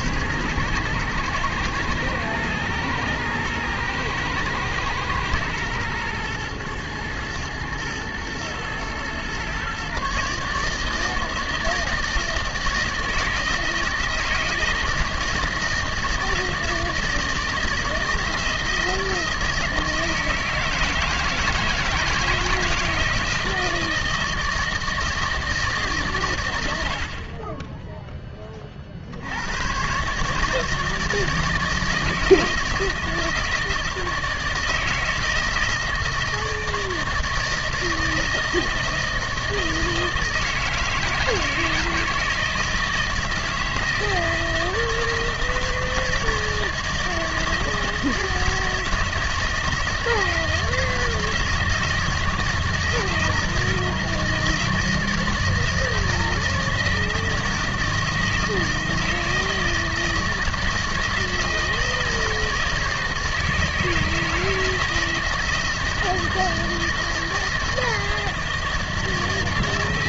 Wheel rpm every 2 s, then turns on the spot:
120, 110, 110, 110, 110, 150, 160, 160, 160, 160, 160, 160, 160, 90, 30, 160, 160, 160, 160, 160, 160, 160, 160, 170, 160, 160, 160, 160, 160, 160, 160, 160, 160, 160, 160.
none